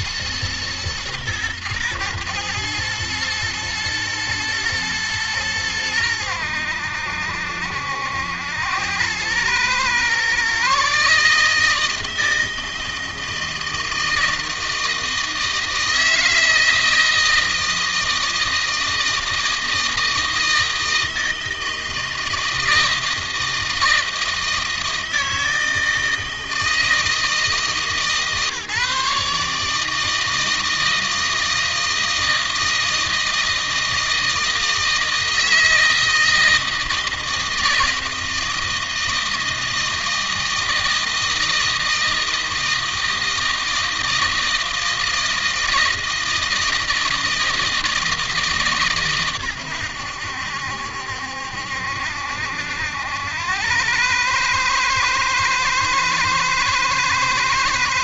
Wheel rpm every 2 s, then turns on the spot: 120, 110, 110, 80, 90, 140, 160, 160, 160, 160, 160, 160, 160, 160, 150, 160, 160, 160, 160, 160, 160, 160, 160, 160, 140, 70, 80, 110, 110.
none